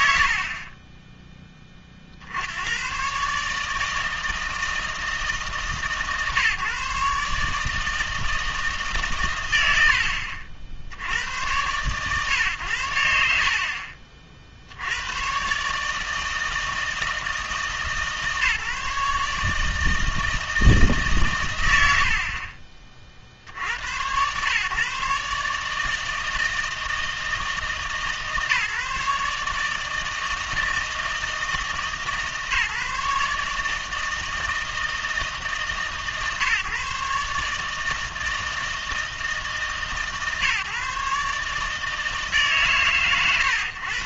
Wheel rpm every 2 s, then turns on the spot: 80, 80, 160, 140, 160, 70, 100, 70, 160, 150, 150, 40, 120, 160, 140, 160, 150, 160, 140, 160, 140, 140.
none